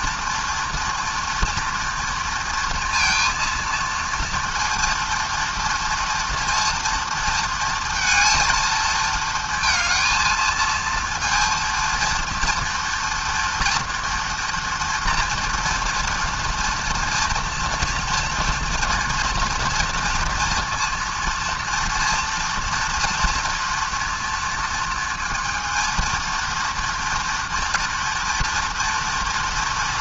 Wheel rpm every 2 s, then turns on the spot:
230, 230, 230, 230, 220, 230, 230, 230, 230, 230, 230, 230, 230, 230, 240.
none